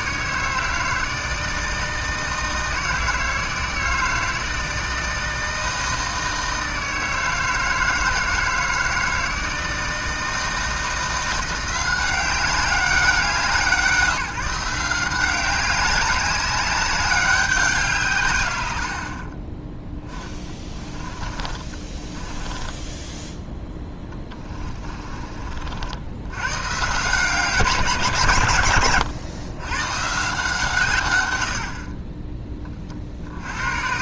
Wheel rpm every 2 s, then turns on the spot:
160, 160, 160, 160, 160, 160, 190, 180, 200, 90, 20, 10, 30, 130, 120, 140, 20.
20-26